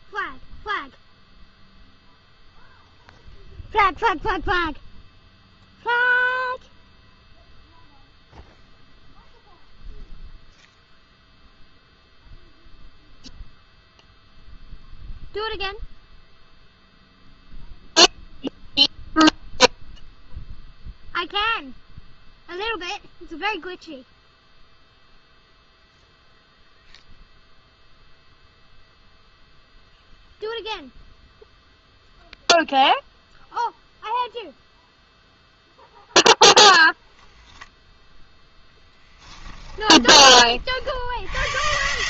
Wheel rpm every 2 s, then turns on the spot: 0, 0, 0, 0, 0, 0, 0, 0, 0, 0, 0, 0, 0, 0, 0, 0, 0, 0, 0, 0, 40.
none